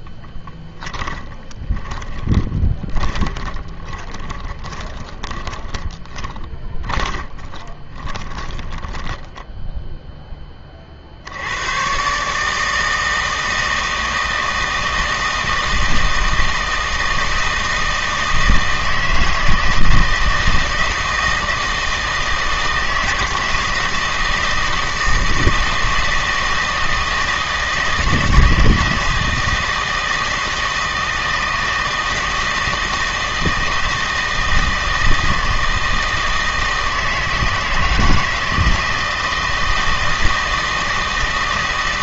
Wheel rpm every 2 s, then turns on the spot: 10, 10, 20, 30, 10, 30, 160, 160, 160, 160, 160, 160, 160, 160, 160, 160, 160, 160, 160, 160, 160.
0-10